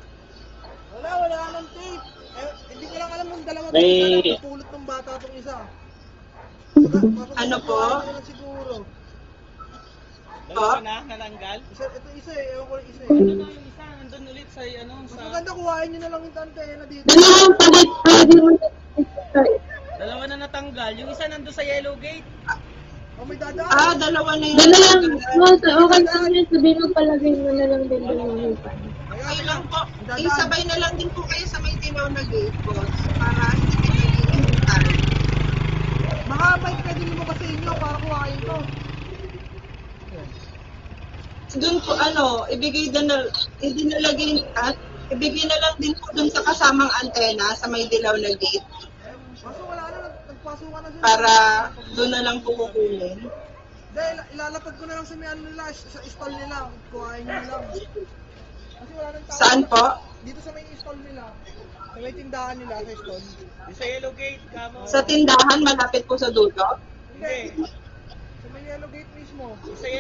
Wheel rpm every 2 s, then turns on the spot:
0, 0, 0, 0, 0, 0, 0, 0, 0, 0, 0, 0, 0, 0, 0, 0, 0, 0, 0, 0, 0, 0, 0, 0, 0, 0, 0, 0, 0, 0, 0, 0, 0, 0, 0.
none